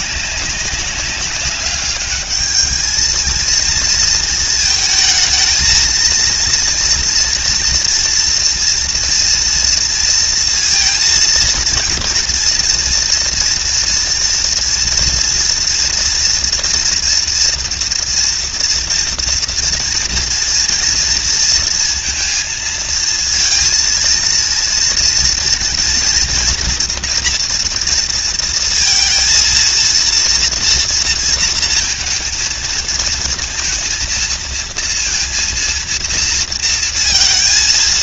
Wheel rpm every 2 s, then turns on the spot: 200, 220, 220, 240, 240, 230, 240, 230, 230, 230, 230, 230, 230, 230, 230, 230, 230, 230, 230.
none